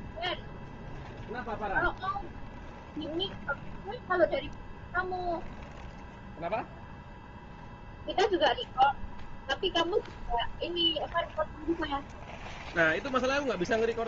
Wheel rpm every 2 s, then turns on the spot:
0, 0, 0, 0, 0, 0, 0.
none